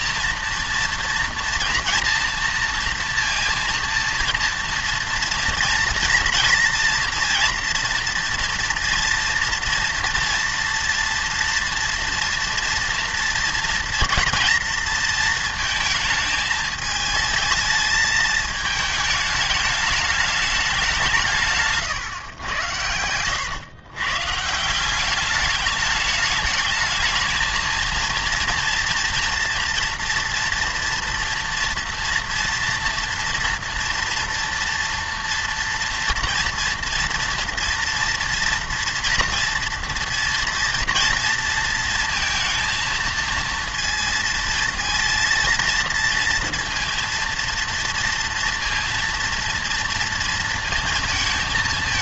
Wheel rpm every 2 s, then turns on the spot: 230, 230, 230, 230, 230, 230, 230, 230, 220, 220, 200, 100, 170, 220, 230, 230, 230, 230, 230, 230, 230, 220, 220, 230, 230, 230.
none